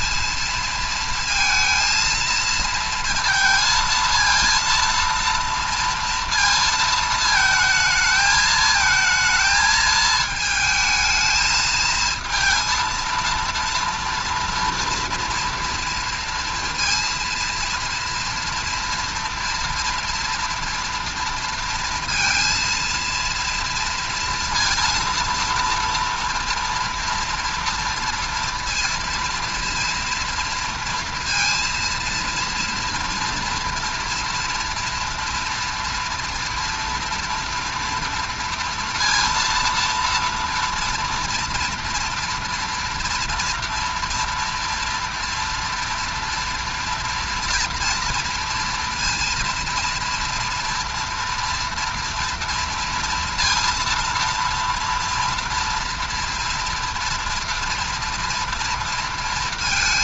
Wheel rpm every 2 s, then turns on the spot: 230, 230, 230, 230, 220, 220, 230, 230, 230, 230, 240, 230, 230, 240, 230, 230, 230, 240, 230, 230, 230, 230, 230, 230, 230, 230, 230, 230, 230, 230.
none